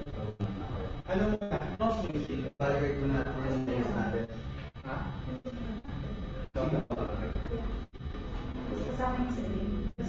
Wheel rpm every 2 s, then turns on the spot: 0, 0, 0, 0, 0.
none